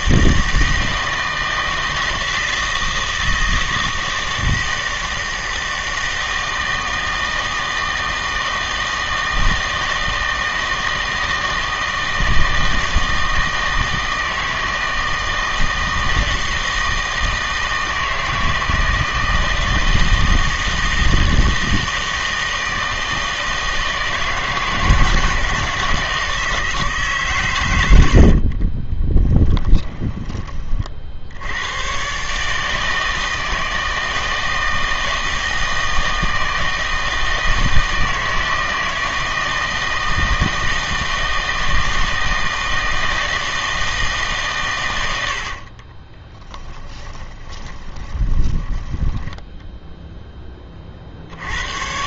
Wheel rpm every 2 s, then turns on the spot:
160, 160, 160, 160, 160, 160, 160, 160, 160, 160, 160, 160, 160, 160, 30, 30, 150, 160, 160, 160, 160, 160, 130, 10, 10, 20.
28-30 46-50